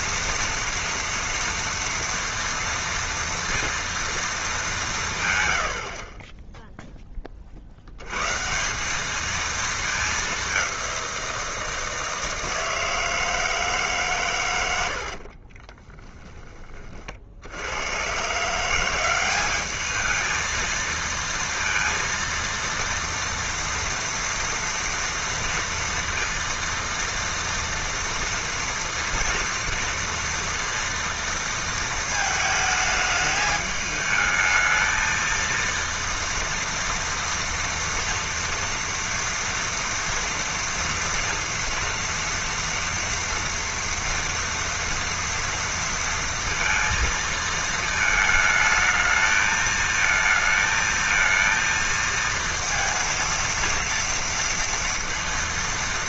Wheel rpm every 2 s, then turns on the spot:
230, 230, 220, 0, 160, 200, 160, 100, 20, 160, 220, 230, 230, 230, 230, 230, 220, 220, 230, 230, 230, 230, 230, 230, 220, 220, 230, 230.
none